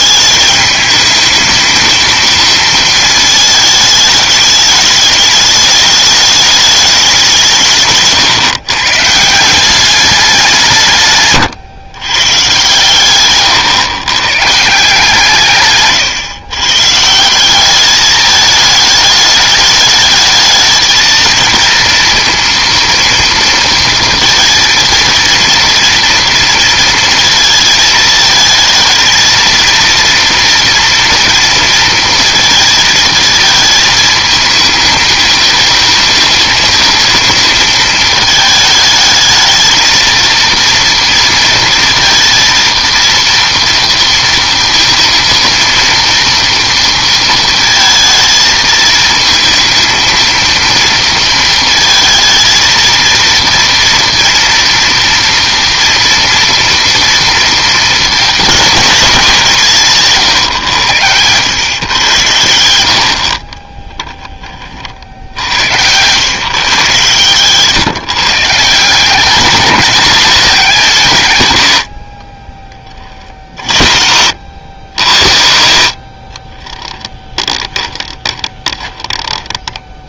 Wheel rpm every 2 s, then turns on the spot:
210, 230, 210, 210, 130, 160, 130, 140, 130, 210, 220, 230, 230, 230, 220, 230, 230, 220, 220, 220, 230, 230, 230, 230, 220, 230, 220, 240, 230, 210, 120, 80, 40, 130, 160, 210, 30, 80, 20, 10.
76-80